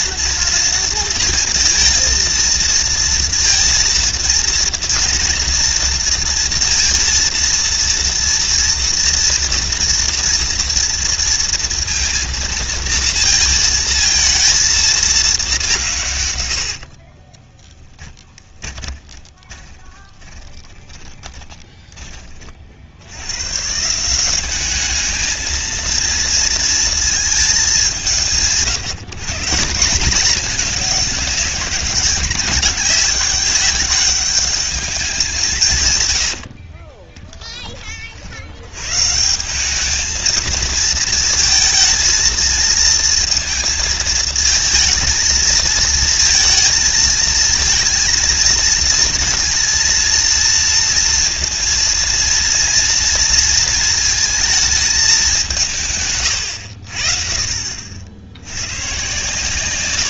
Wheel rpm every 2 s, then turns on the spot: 230, 230, 230, 230, 230, 230, 230, 220, 90, 10, 20, 40, 200, 230, 160, 200, 190, 200, 70, 70, 220, 220, 230, 230, 230, 230, 230, 220, 100, 100.
16-22 36-38